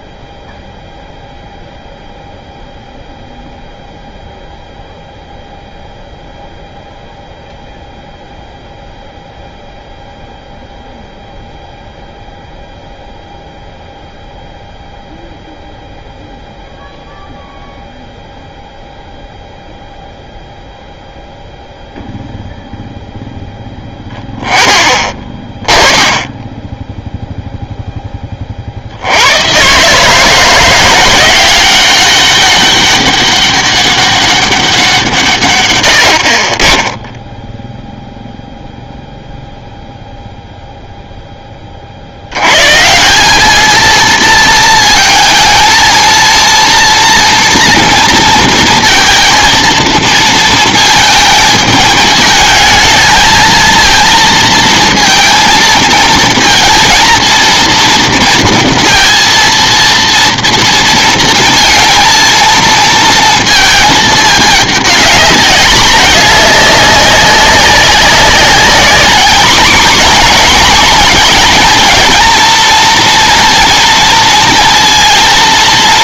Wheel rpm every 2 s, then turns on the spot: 0, 0, 0, 0, 0, 0, 0, 0, 0, 0, 0, 0, 10, 10, 50, 170, 200, 200, 50, 0, 0, 130, 230, 230, 230, 220, 220, 230, 230, 230, 230, 230, 210, 200, 210, 240, 220, 230.
none